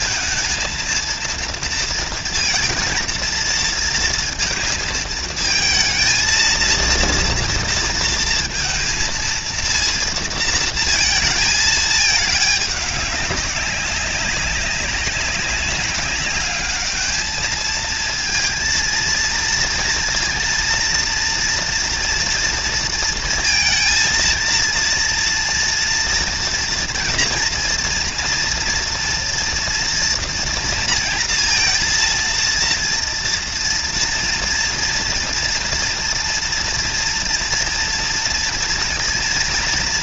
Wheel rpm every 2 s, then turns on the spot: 230, 230, 220, 230, 230, 230, 210, 190, 210, 230, 230, 230, 230, 230, 230, 230, 230, 230, 240, 230.
none